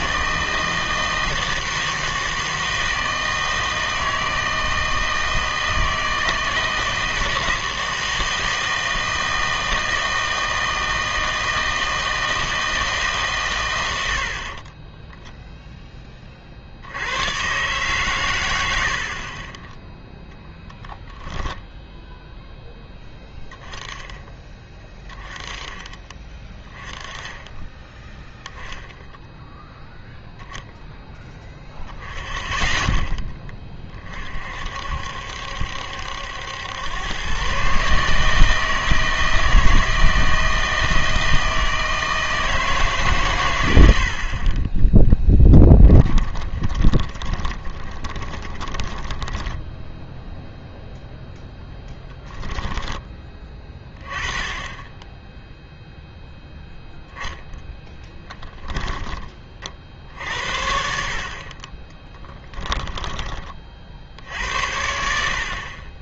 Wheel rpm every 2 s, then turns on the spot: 160, 160, 160, 160, 160, 160, 160, 20, 70, 70, 0, 10, 20, 10, 0, 0, 10, 60, 100, 160, 160, 150, 20, 20, 10, 0, 10, 10, 0, 10, 70, 20, 70.
14-16 18-20 46-50 58-60 62-64